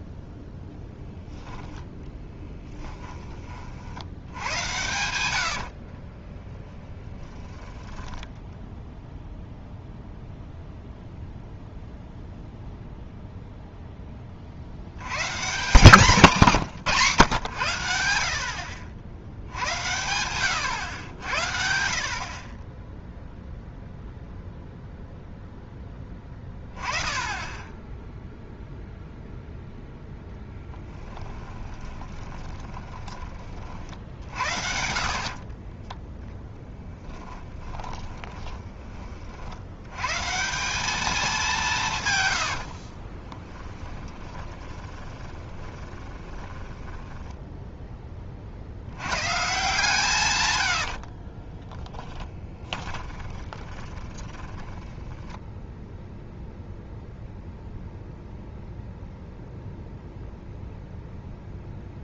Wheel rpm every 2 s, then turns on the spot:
0, 10, 100, 10, 0, 0, 0, 80, 160, 60, 100, 20, 0, 10, 0, 10, 20, 60, 0, 30, 200, 40, 20, 10, 70, 70, 20, 10, 0, 0, 0.
2-6 30-32 34-36 42-48 50-56